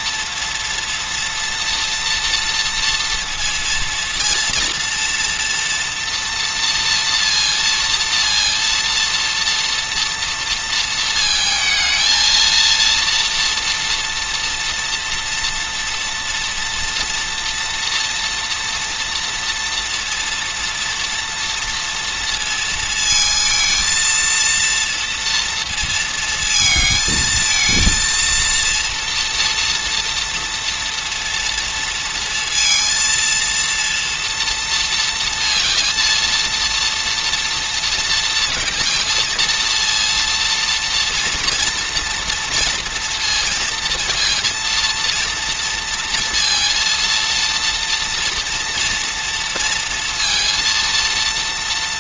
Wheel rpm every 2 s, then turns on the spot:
240, 230, 230, 230, 230, 230, 230, 230, 230, 230, 230, 230, 230, 220, 230, 240, 230, 230, 230, 230, 230, 230, 230, 230, 230, 230.
none